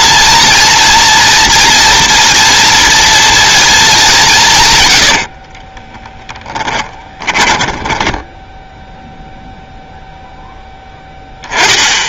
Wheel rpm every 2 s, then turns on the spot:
230, 240, 130, 10, 0, 0.
6-8